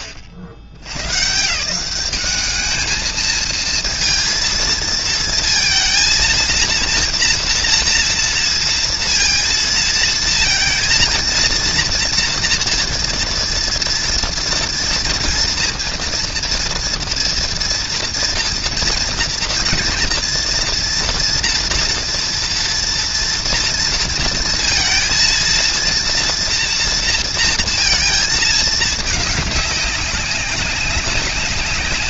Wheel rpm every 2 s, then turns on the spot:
80, 220, 230, 230, 230, 230, 240, 230, 240, 230, 230, 230, 230, 230, 210, 200.
none